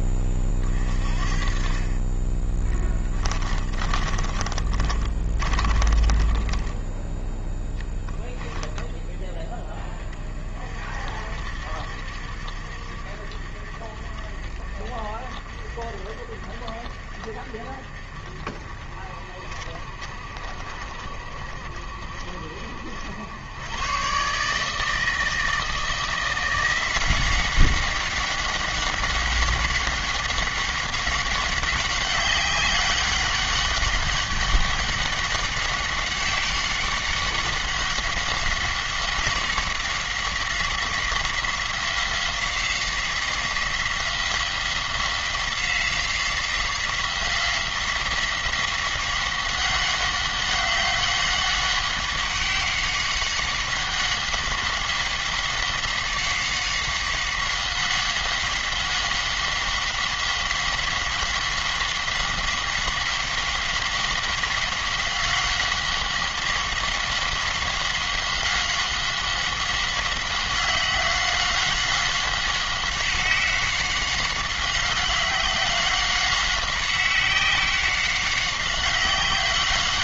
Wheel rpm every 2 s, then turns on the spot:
40, 20, 30, 10, 10, 50, 60, 50, 50, 50, 50, 70, 150, 180, 190, 190, 190, 200, 190, 190, 180, 180, 180, 180, 190, 190, 190, 190, 190, 190, 190, 190, 190, 190, 190, 190, 190, 190, 190, 190.
2-8